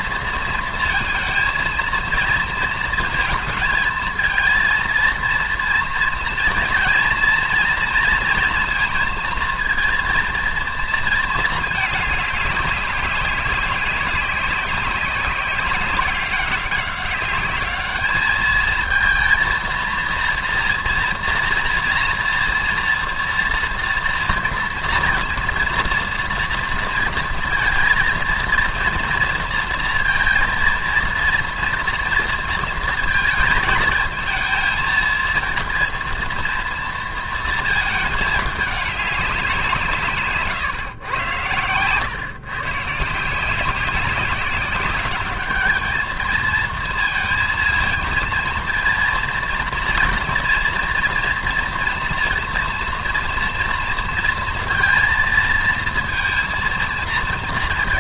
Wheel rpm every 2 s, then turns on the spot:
220, 220, 230, 240, 230, 230, 200, 190, 190, 220, 230, 230, 230, 230, 230, 230, 220, 220, 230, 200, 120, 140, 200, 220, 230, 230, 240, 230, 230.
none